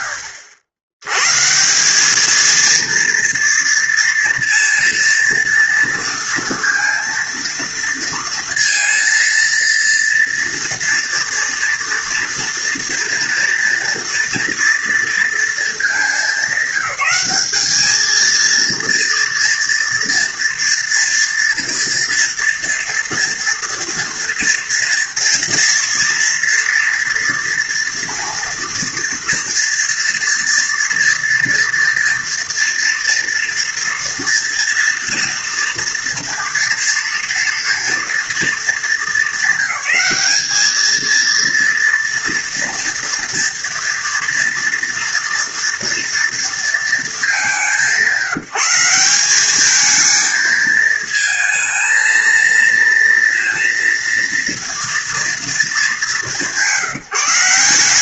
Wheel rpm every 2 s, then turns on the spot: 70, 230, 230, 230, 230, 240, 230, 230, 200, 230, 230, 230, 230, 230, 230, 240, 230, 230, 230, 210, 220, 230, 230, 210, 190, 220, 230, 230, 170.
none